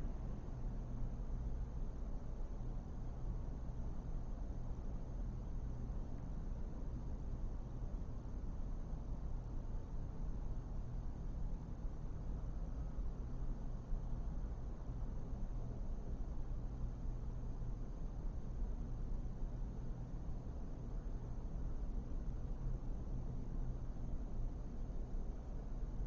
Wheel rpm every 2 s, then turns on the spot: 0, 0, 0, 0, 0, 0, 0, 0, 0, 0, 0, 0, 0.
none